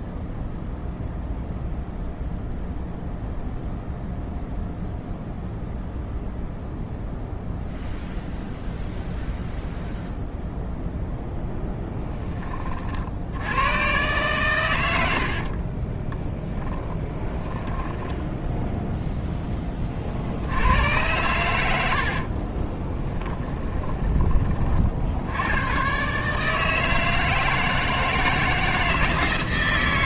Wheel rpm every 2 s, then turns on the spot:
0, 0, 0, 0, 0, 0, 30, 110, 10, 0, 90, 20, 30, 160, 160.
16-18 22-24